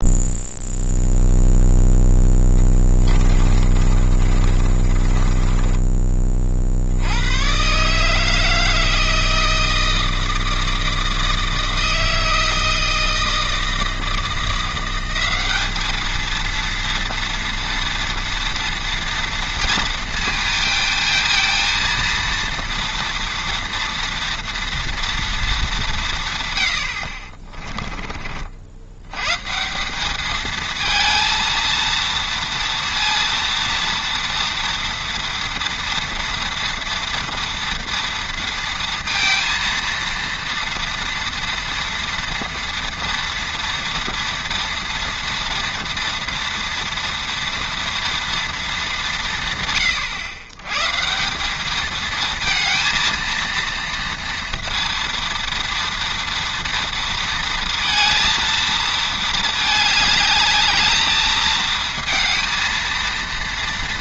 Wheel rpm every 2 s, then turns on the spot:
0, 10, 30, 50, 160, 160, 160, 170, 230, 230, 220, 230, 230, 110, 70, 220, 230, 230, 230, 230, 230, 230, 230, 230, 210, 110, 230, 230, 230, 230, 210, 230.
2-6 26-28